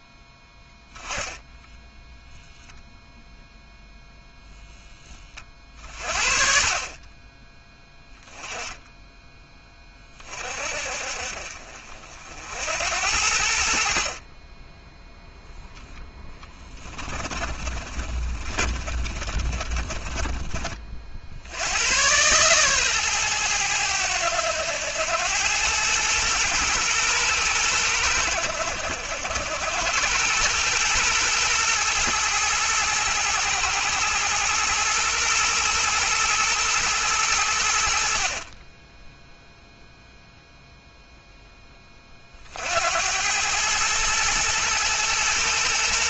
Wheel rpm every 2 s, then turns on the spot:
10, 0, 10, 20, 10, 50, 80, 10, 20, 30, 50, 120, 100, 110, 70, 110, 110, 110, 110, 10, 0, 80, 110.
0-2 6-8 16-20